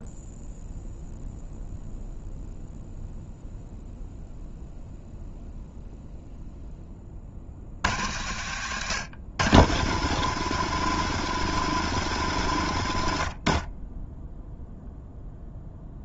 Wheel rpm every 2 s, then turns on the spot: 0, 0, 0, 30, 100, 140, 80, 0.
none